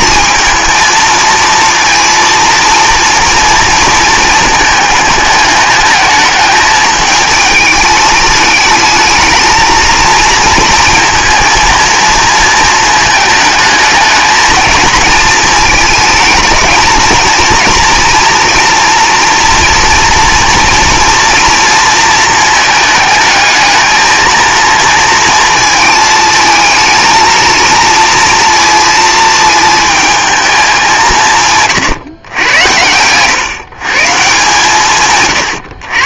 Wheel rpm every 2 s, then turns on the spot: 230, 230, 220, 210, 220, 230, 220, 220, 220, 230, 230, 220, 230, 220, 230, 200, 100, 150.
none